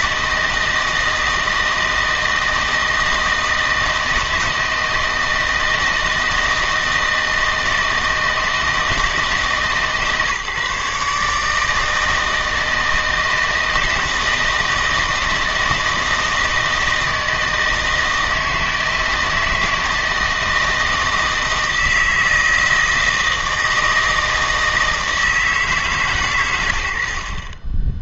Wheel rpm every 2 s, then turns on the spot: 160, 160, 160, 160, 160, 140, 160, 160, 160, 160, 160, 160, 160, 90.
none